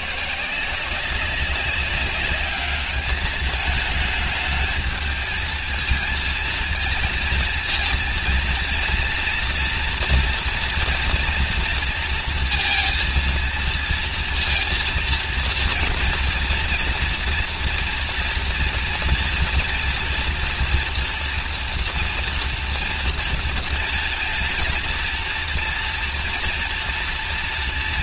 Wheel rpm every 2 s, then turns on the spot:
190, 210, 220, 220, 230, 230, 230, 230, 230, 230, 230, 230, 230, 230.
none